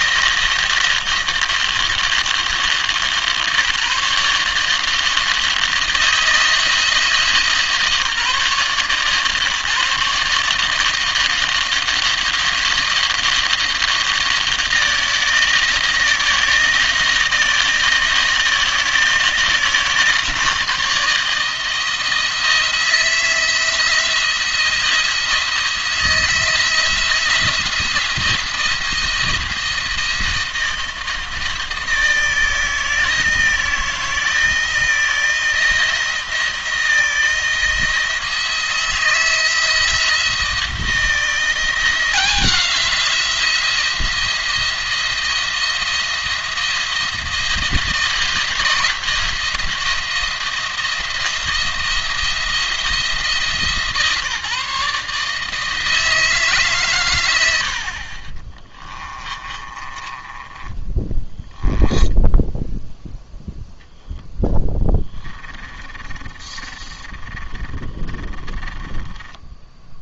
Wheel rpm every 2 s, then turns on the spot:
160, 150, 160, 160, 140, 150, 170, 160, 160, 160, 160, 170, 170, 170, 170, 160, 160, 160, 170, 170, 170, 180, 170, 170, 170, 170, 170, 150, 130, 20, 20, 0, 10, 20, 20.
58-62 64-70